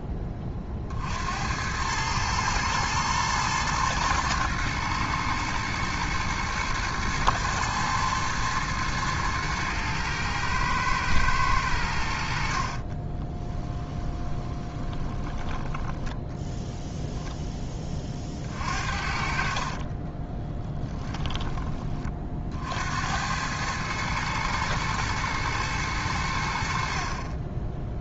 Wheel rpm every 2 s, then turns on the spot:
40, 110, 110, 110, 110, 110, 40, 20, 0, 50, 10, 70, 110, 50.
12-16 20-22